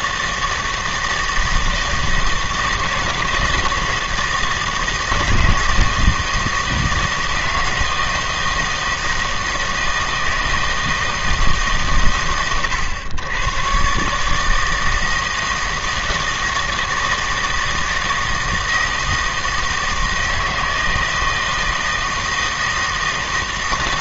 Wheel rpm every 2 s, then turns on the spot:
160, 160, 160, 160, 160, 160, 110, 160, 160, 160, 160, 160.
none